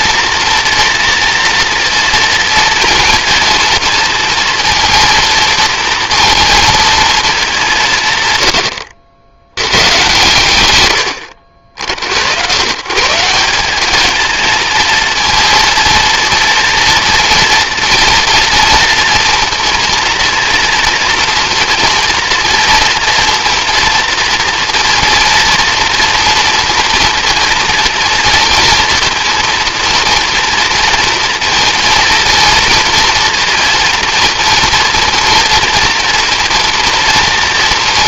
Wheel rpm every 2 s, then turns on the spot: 230, 230, 230, 210, 90, 90, 170, 230, 230, 230, 230, 230, 230, 230, 230, 230, 230, 230, 230.
10-12